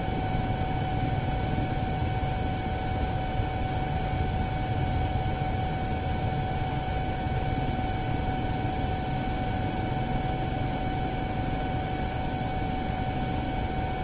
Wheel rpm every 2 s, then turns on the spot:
0, 0, 0, 0, 0, 0, 0.
none